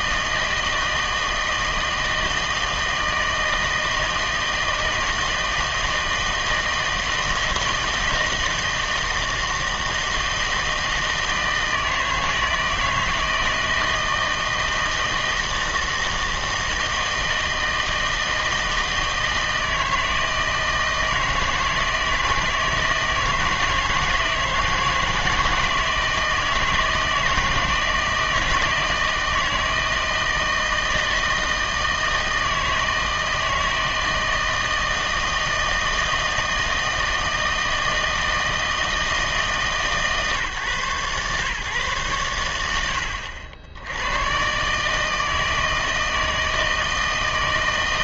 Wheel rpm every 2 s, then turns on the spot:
160, 160, 160, 160, 160, 160, 160, 160, 160, 160, 160, 160, 160, 160, 160, 160, 160, 160, 160, 160, 140, 90, 140, 160.
none